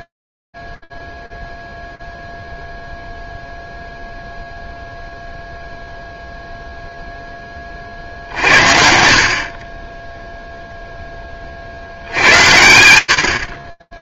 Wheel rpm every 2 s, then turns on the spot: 0, 0, 0, 0, 50, 10, 80.
none